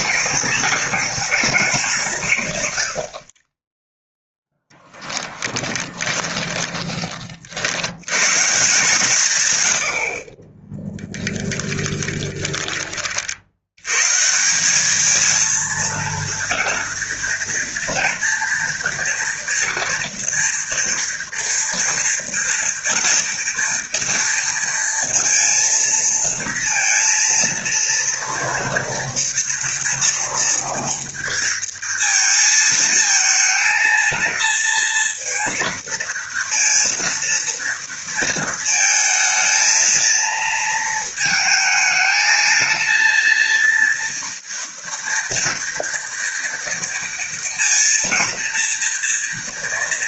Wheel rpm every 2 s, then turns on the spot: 240, 100, 10, 20, 170, 20, 40, 210, 230, 230, 230, 230, 230, 230, 230, 230, 230, 230, 230, 220, 220, 230, 230, 230, 230.
10-12